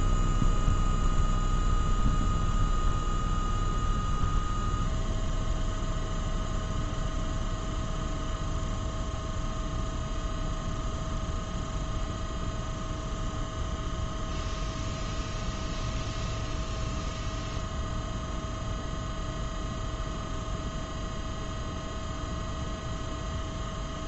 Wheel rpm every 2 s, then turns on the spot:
0, 0, 0, 0, 0, 0, 0, 0, 0, 0, 0, 0.
none